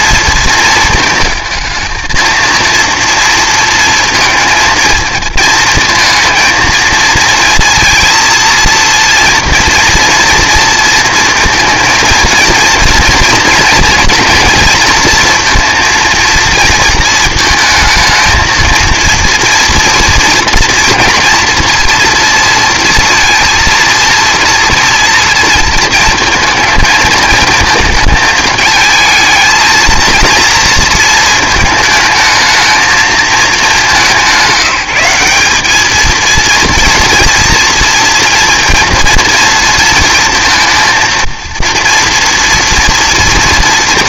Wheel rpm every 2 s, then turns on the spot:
230, 230, 220, 230, 230, 230, 230, 230, 230, 230, 230, 230, 230, 220, 220, 230, 220, 190, 230, 230, 230, 230.
none